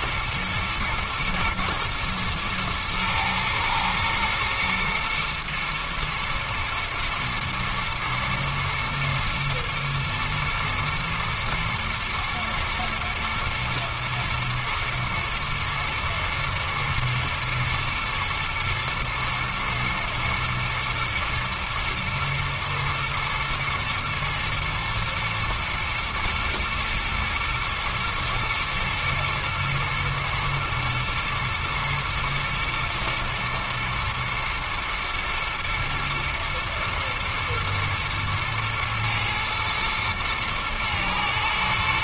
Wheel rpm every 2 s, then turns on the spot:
120, 110, 110, 110, 120, 110, 110, 120, 110, 110, 120, 110, 120, 120, 120, 120, 110, 120, 120, 110, 120.
none